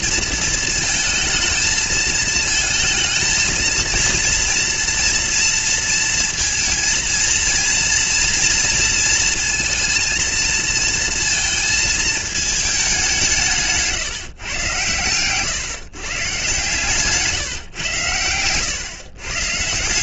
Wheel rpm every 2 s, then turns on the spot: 230, 220, 230, 230, 230, 230, 220, 120, 140, 110.
none